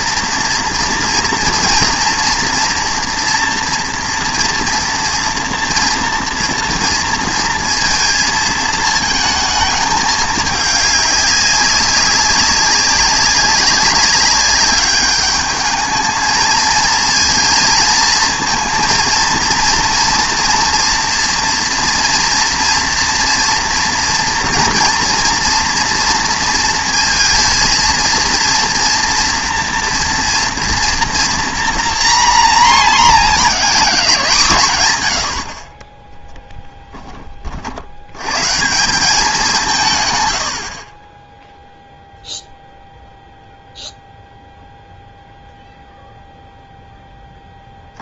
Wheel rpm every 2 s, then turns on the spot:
230, 240, 230, 230, 220, 200, 190, 200, 230, 230, 230, 230, 240, 230, 230, 230, 240, 130, 10, 170, 60, 0, 0, 0.
none